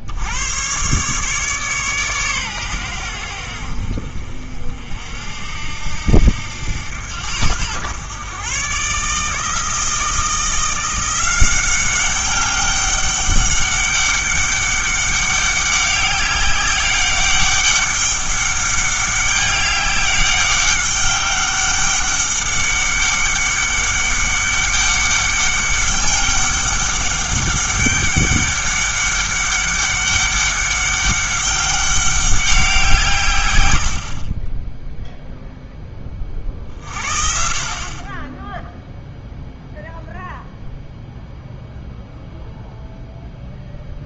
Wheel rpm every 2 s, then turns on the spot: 120, 110, 60, 90, 130, 170, 200, 200, 190, 200, 200, 200, 200, 200, 200, 200, 180, 10, 40, 0, 0, 0.
none